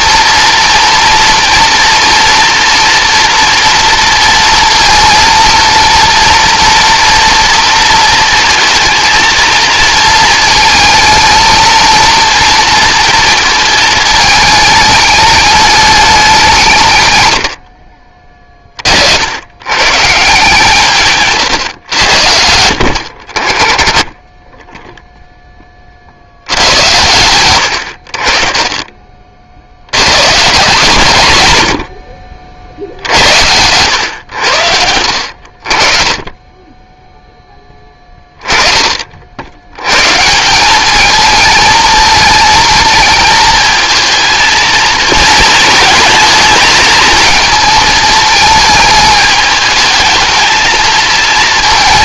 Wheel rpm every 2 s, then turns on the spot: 230, 230, 230, 240, 230, 220, 230, 210, 130, 50, 150, 70, 10, 100, 40, 140, 50, 70, 20, 20, 200, 220, 220, 220, 220, 220.
36-38